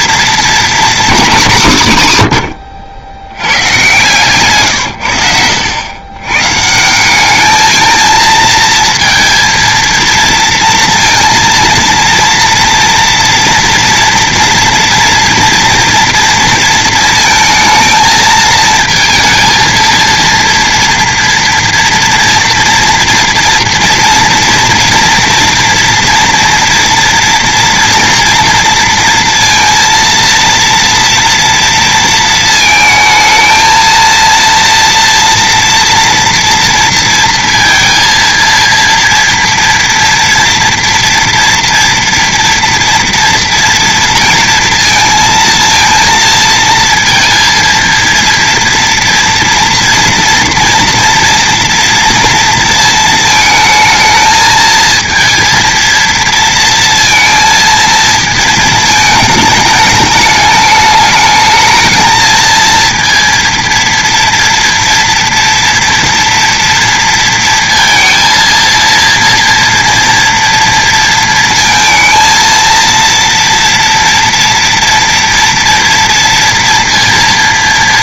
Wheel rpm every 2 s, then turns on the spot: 230, 80, 130, 150, 230, 230, 230, 230, 230, 220, 230, 230, 230, 230, 230, 230, 220, 230, 230, 230, 230, 230, 230, 230, 230, 230, 230, 220, 230, 220, 210, 230, 230, 230, 230, 230, 230, 230, 230.
none